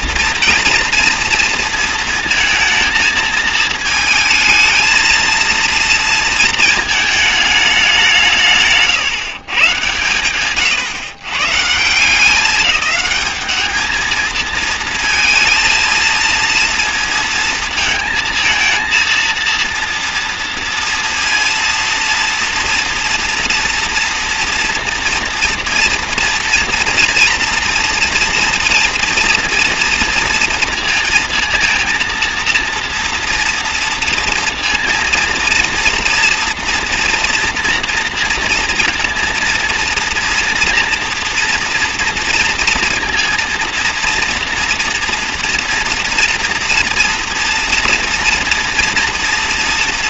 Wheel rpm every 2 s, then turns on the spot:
230, 230, 220, 220, 150, 130, 200, 230, 230, 230, 230, 230, 240, 230, 230, 230, 230, 230, 230, 230, 230, 230, 230, 230, 230.
none